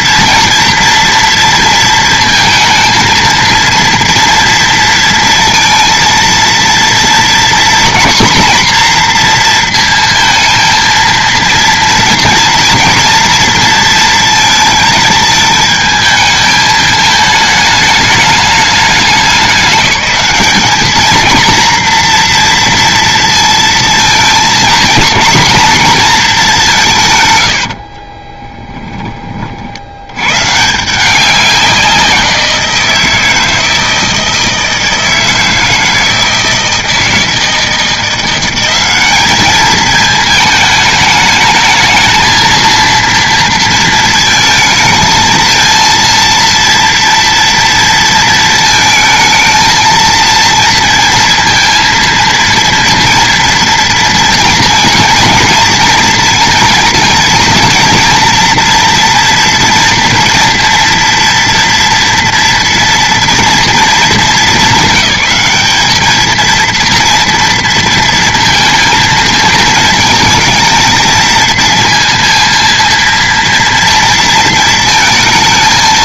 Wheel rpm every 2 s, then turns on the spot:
230, 230, 230, 230, 240, 230, 230, 230, 220, 210, 220, 240, 220, 180, 20, 140, 170, 160, 160, 190, 220, 230, 220, 230, 220, 230, 230, 230, 230, 240, 230, 230, 200, 230, 230, 230, 230, 230.
28-30